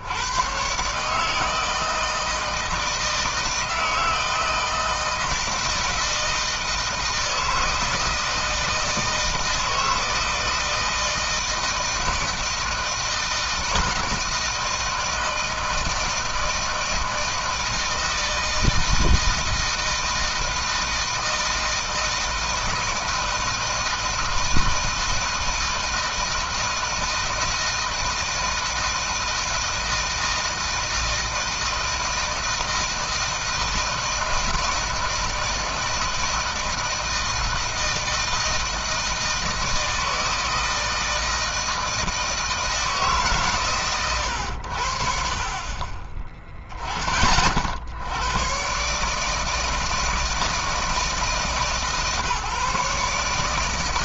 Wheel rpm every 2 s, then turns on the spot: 140, 160, 160, 160, 160, 160, 160, 160, 160, 160, 160, 160, 160, 160, 160, 160, 160, 170, 160, 160, 160, 160, 60, 20, 140, 160, 150.
none